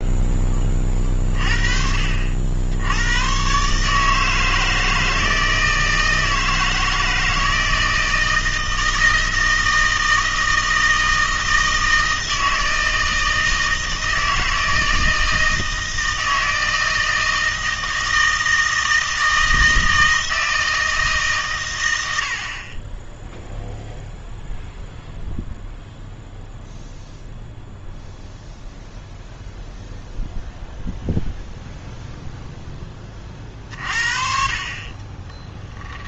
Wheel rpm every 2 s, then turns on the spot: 30, 70, 160, 160, 160, 160, 160, 160, 160, 160, 160, 30, 0, 0, 0, 0, 10, 40.
none